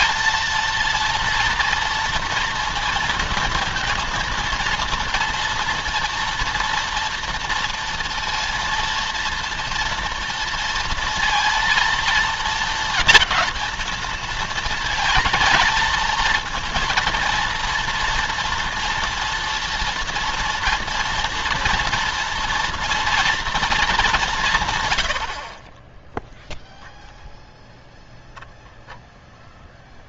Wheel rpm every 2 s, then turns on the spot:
230, 230, 230, 230, 230, 230, 230, 230, 230, 230, 230, 230, 120, 0, 0.
none